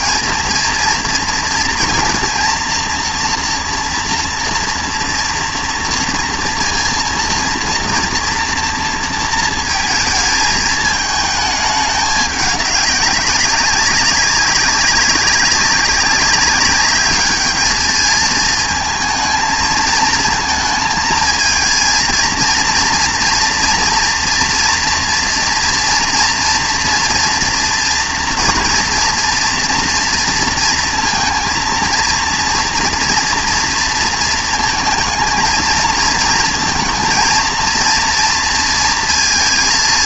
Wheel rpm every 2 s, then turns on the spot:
230, 230, 230, 230, 230, 220, 200, 200, 200, 230, 220, 230, 230, 230, 230, 230, 230, 230, 230, 230.
none